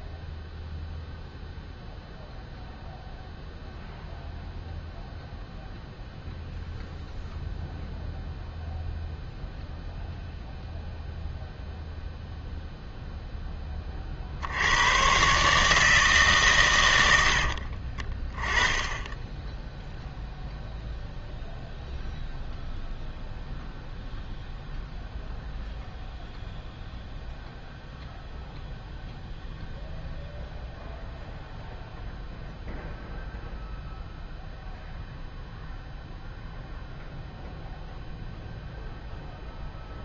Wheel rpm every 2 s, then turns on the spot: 0, 0, 0, 0, 0, 0, 0, 100, 120, 10, 0, 0, 0, 0, 0, 0, 0, 0, 0, 0.
none